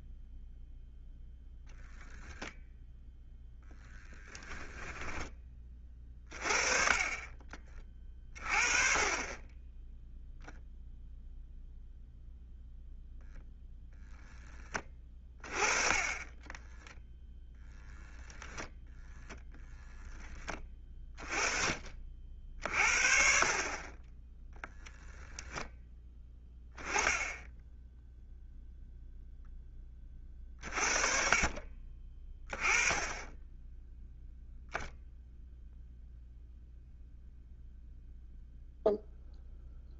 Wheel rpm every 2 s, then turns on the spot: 0, 0, 10, 20, 30, 0, 0, 20, 10, 0, 20, 50, 0, 10, 0, 40, 10, 0, 0, 0.
16-18